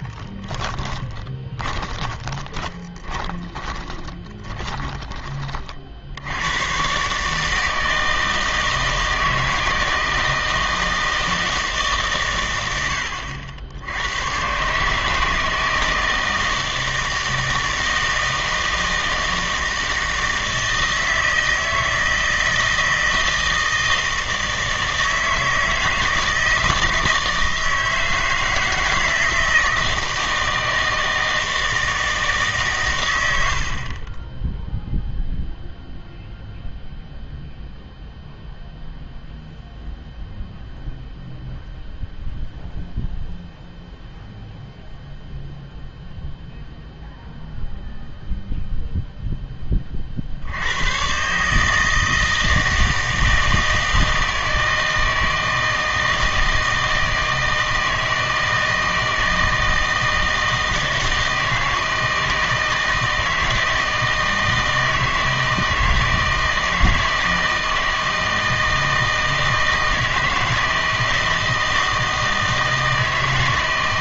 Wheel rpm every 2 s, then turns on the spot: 10, 20, 20, 100, 160, 160, 100, 130, 160, 160, 160, 160, 160, 160, 160, 160, 140, 0, 0, 0, 0, 0, 0, 0, 0, 80, 160, 160, 160, 160, 160, 160, 160, 160, 160, 160, 160.
0-6